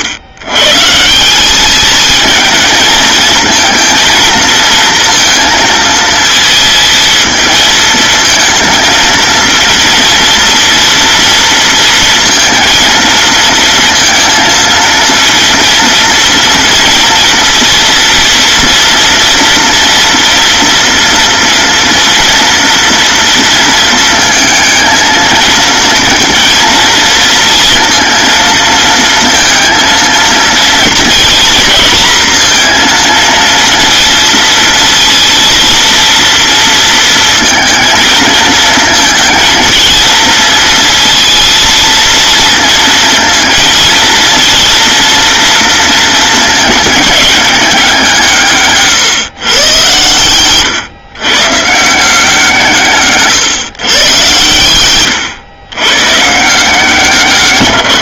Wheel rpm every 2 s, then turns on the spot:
140, 220, 230, 230, 230, 230, 230, 230, 230, 230, 230, 230, 230, 230, 230, 230, 230, 230, 230, 220, 230, 230, 230, 220, 150, 130, 160, 120, 160.
none